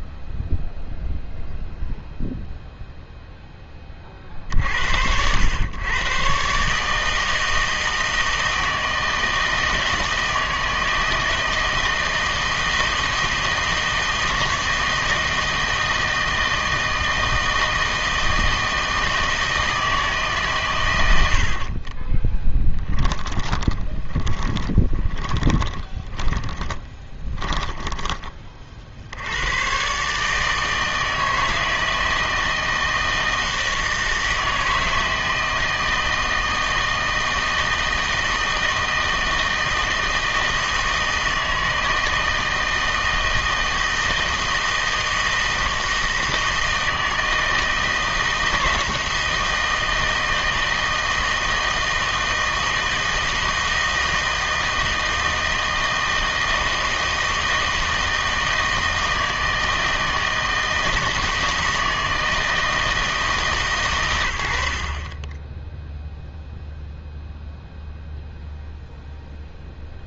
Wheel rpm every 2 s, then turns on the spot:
0, 0, 70, 150, 160, 160, 160, 160, 160, 160, 130, 10, 20, 30, 50, 160, 160, 160, 160, 160, 160, 160, 160, 160, 160, 160, 160, 160, 160, 160, 160, 160, 60, 0, 0.
22-28